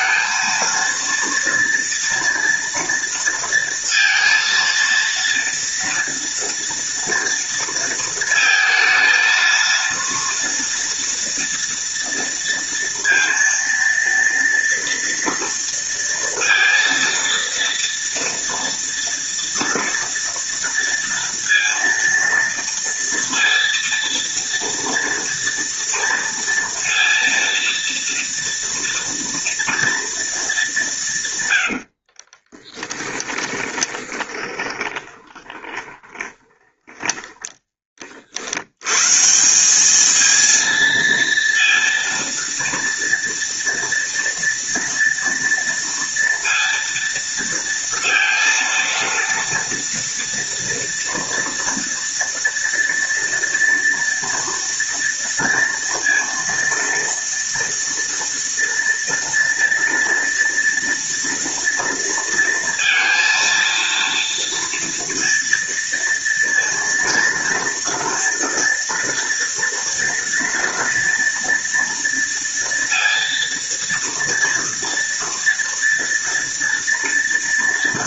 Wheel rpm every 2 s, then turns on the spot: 230, 230, 230, 230, 230, 230, 230, 230, 230, 230, 230, 230, 230, 230, 230, 190, 10, 20, 10, 100, 230, 230, 240, 230, 230, 230, 230, 230, 230, 230, 230, 230, 230, 230, 230, 230, 230, 230, 230.
32-36